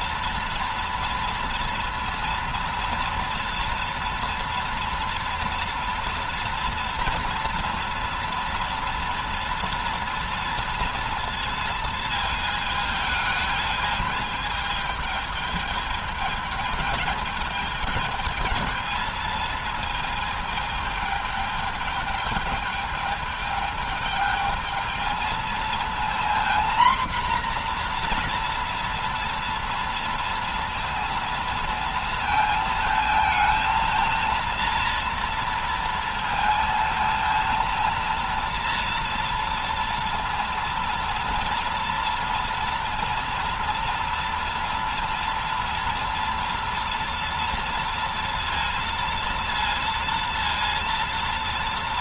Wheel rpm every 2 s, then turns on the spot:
230, 230, 230, 230, 230, 230, 220, 210, 210, 220, 210, 210, 210, 240, 240, 230, 230, 230, 230, 230, 230, 230, 230, 230, 230, 230.
none